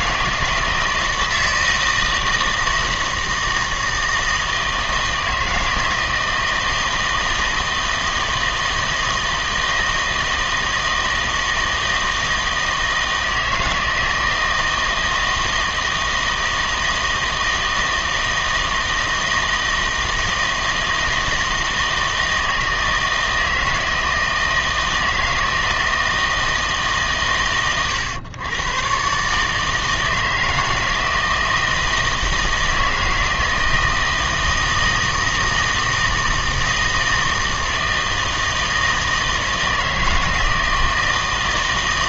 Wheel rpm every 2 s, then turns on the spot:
160, 160, 160, 160, 160, 160, 160, 160, 160, 160, 160, 160, 160, 160, 120, 160, 160, 160, 160, 160, 160.
none